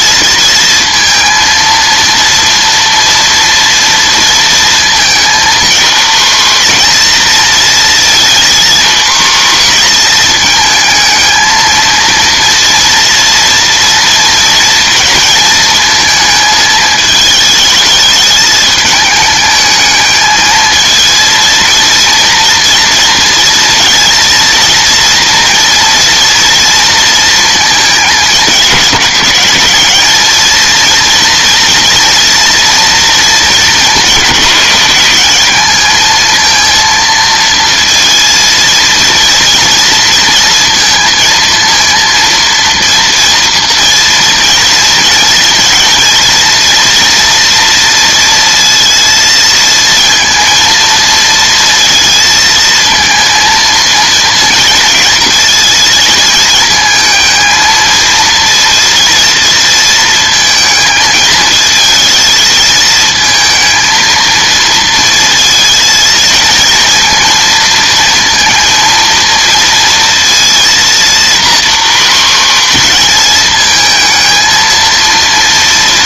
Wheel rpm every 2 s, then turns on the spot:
230, 230, 230, 240, 240, 220, 230, 230, 220, 220, 220, 230, 230, 230, 210, 230, 230, 200, 230, 230, 230, 230, 230, 230, 230, 230, 230, 230, 220, 230, 220, 220, 230, 230, 230, 230, 240, 230.
none